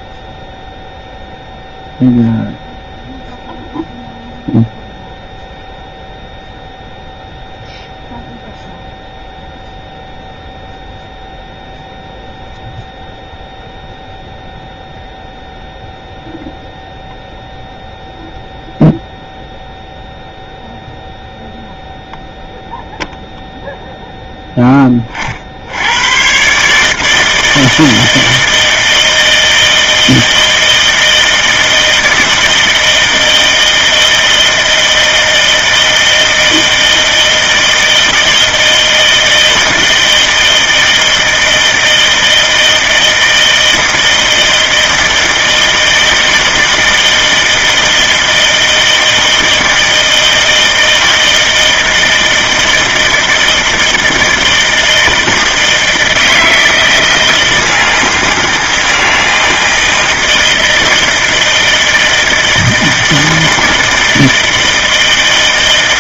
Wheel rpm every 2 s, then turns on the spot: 0, 0, 0, 0, 0, 0, 0, 0, 0, 0, 0, 0, 10, 130, 160, 160, 160, 160, 160, 160, 160, 160, 160, 160, 160, 160, 160, 160, 160, 160, 160, 160, 160.
none